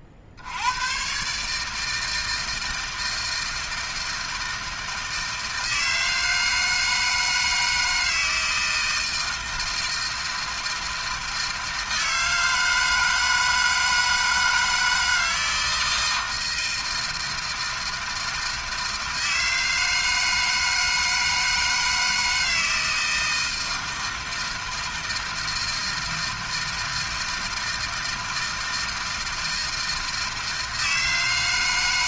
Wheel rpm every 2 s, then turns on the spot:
90, 160, 160, 160, 160, 160, 160, 160, 160, 160, 160, 160, 160, 160, 160, 160.
none